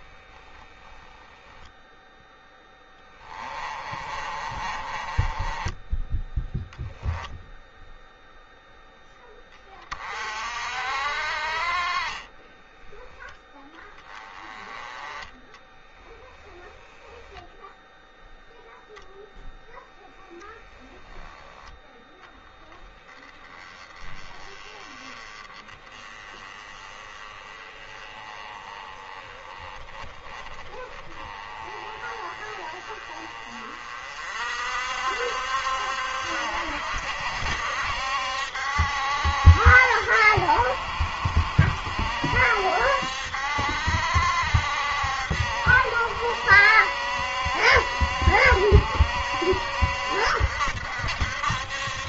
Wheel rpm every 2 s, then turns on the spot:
10, 10, 30, 10, 0, 50, 20, 20, 0, 0, 0, 10, 20, 20, 30, 30, 30, 50, 70, 70, 60, 70, 70, 70, 70, 70.
0-6 12-14